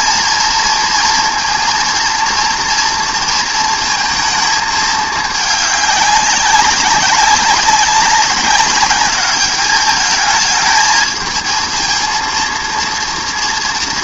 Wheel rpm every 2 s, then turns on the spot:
230, 230, 230, 210, 200, 210, 220.
none